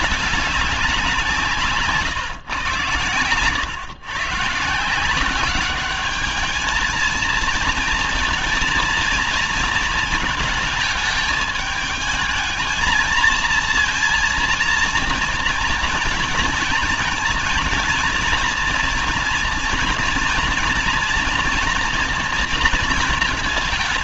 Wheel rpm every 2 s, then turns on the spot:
200, 120, 150, 210, 230, 220, 220, 230, 230, 230, 240, 230.
none